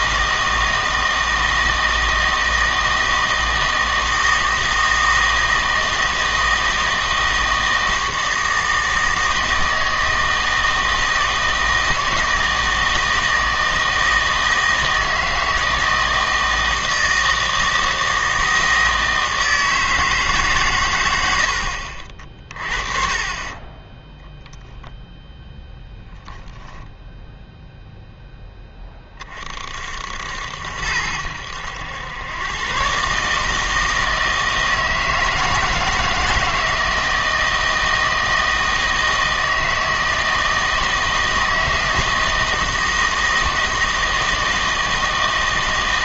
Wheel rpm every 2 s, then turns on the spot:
160, 160, 160, 160, 160, 160, 160, 160, 160, 160, 120, 40, 0, 0, 20, 80, 130, 160, 160, 160, 160, 160, 160.
none